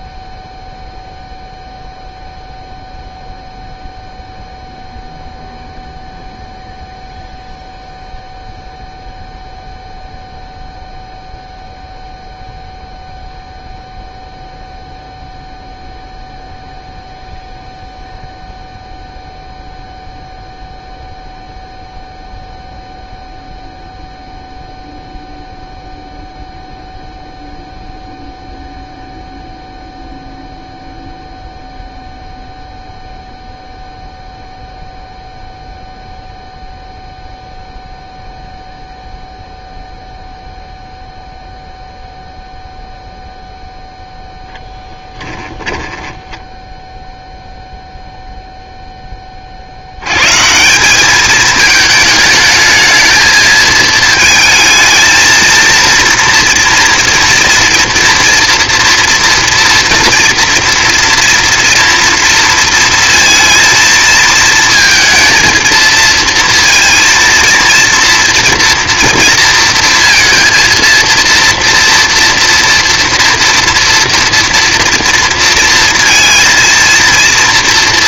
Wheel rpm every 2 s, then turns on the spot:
0, 0, 0, 0, 0, 0, 0, 0, 0, 0, 0, 0, 0, 0, 0, 0, 0, 0, 0, 0, 0, 0, 10, 10, 0, 180, 220, 220, 230, 230, 230, 230, 230, 230, 230, 230, 230, 230, 230.
44-46